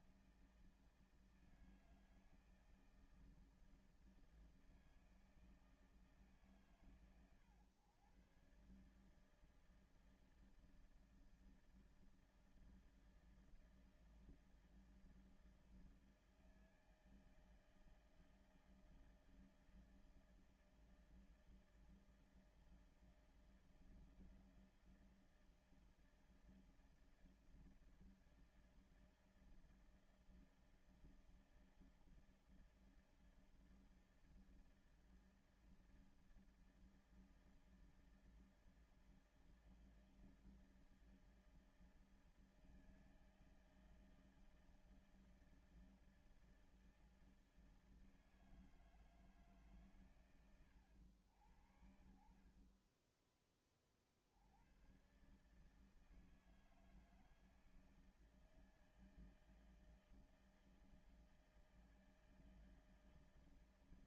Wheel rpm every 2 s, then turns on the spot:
160, 160, 160, 140, 130, 160, 160, 160, 160, 160, 160, 160, 160, 160, 160, 160, 160, 160, 160, 160, 160, 160, 160, 160, 160, 100, 30, 80, 160, 160, 160, 160.
52-54